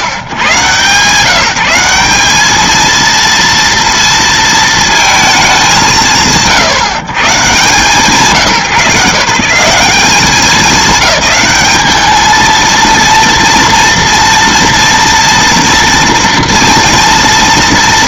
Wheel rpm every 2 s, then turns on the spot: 110, 210, 230, 90, 150, 190, 220, 230, 230.
none